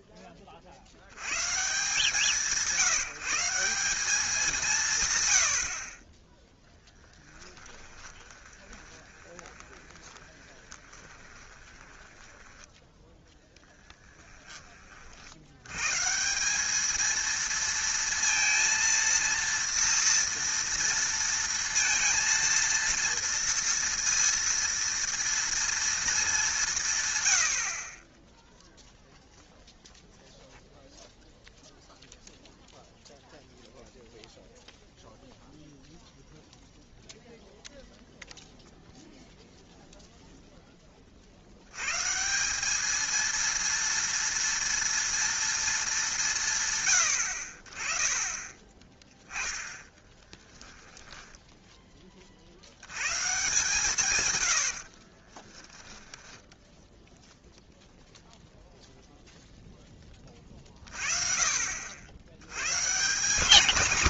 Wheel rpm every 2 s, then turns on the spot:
40, 170, 170, 10, 20, 20, 10, 30, 210, 230, 230, 230, 230, 180, 0, 0, 0, 0, 0, 0, 10, 200, 230, 110, 20, 10, 80, 80, 0, 0, 30, 140.
6-12 50-52